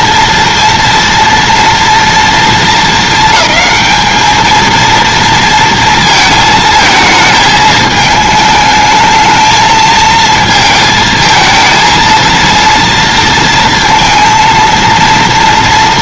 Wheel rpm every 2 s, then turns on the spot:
230, 230, 220, 220, 220, 220, 230, 230.
none